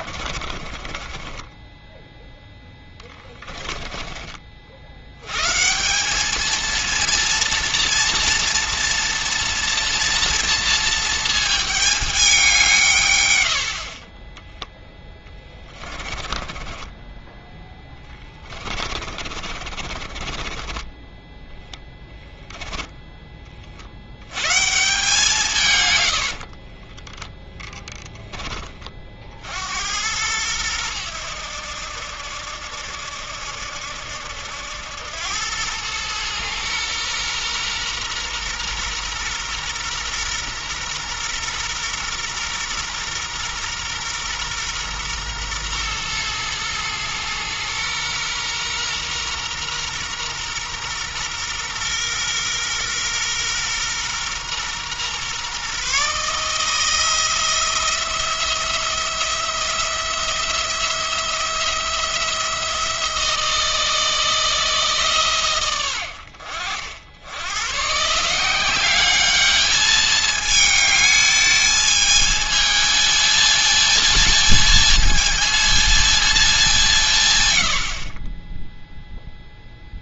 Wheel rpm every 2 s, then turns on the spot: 30, 10, 50, 220, 230, 230, 180, 10, 20, 30, 30, 10, 140, 30, 30, 100, 80, 90, 120, 120, 120, 120, 120, 120, 120, 120, 120, 120, 160, 170, 170, 170, 160, 70, 190, 220, 220, 220, 190, 0.
0-4 14-22 26-28